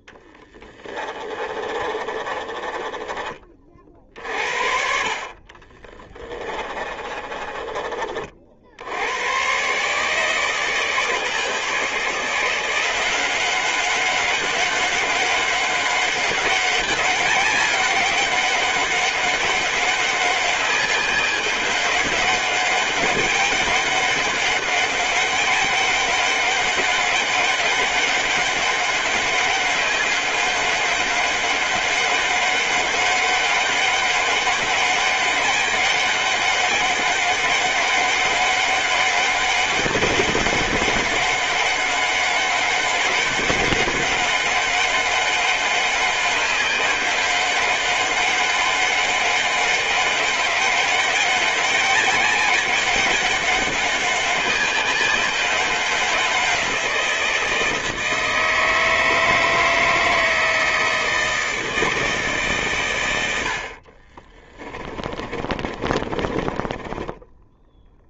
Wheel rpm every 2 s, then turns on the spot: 20, 30, 40, 30, 90, 160, 180, 190, 200, 190, 190, 200, 200, 200, 200, 190, 190, 200, 200, 200, 190, 200, 190, 190, 200, 190, 190, 190, 170, 160, 160, 110, 30, 10.
0-2 6-8 64-66